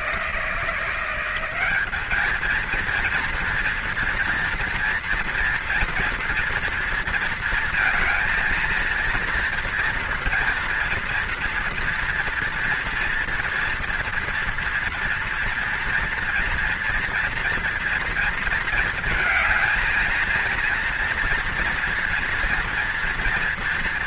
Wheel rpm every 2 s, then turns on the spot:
170, 230, 230, 230, 230, 230, 230, 230, 230, 220, 230, 230.
none